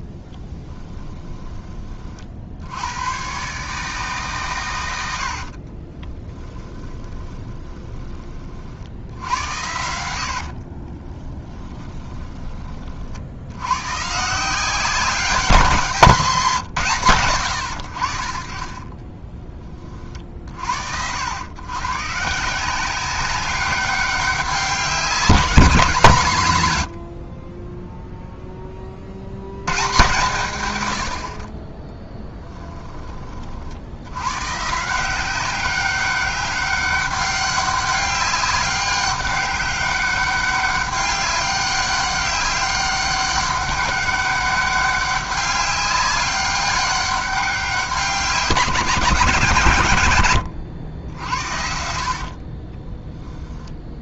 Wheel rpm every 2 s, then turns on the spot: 10, 90, 100, 20, 60, 30, 40, 180, 150, 40, 90, 180, 190, 90, 30, 110, 20, 160, 200, 200, 200, 200, 200, 200, 170, 90, 20.
0-2 4-8 10-12 18-20 52-54